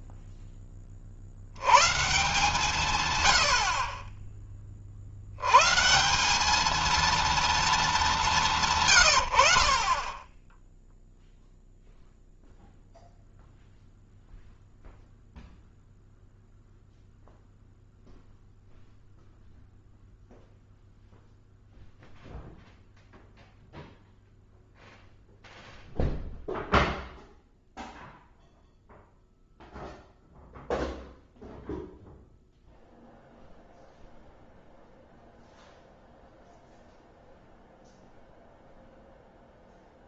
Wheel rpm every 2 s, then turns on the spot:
10, 160, 30, 210, 170, 10, 0, 0, 0, 0, 0, 0, 0, 0, 0, 0, 0, 0, 0, 0.
none